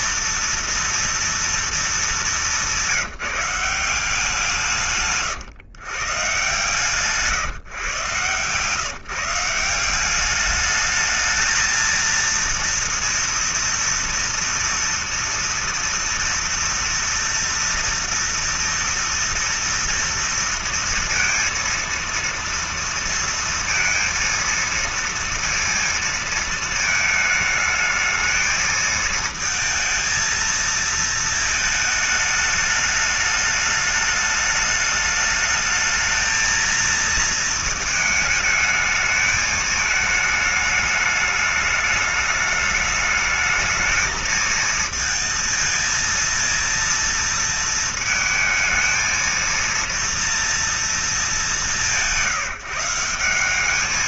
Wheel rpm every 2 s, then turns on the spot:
230, 210, 170, 130, 130, 200, 230, 230, 230, 230, 230, 230, 230, 230, 220, 230, 220, 210, 220, 220, 220, 210, 220, 230, 220, 230, 180.
none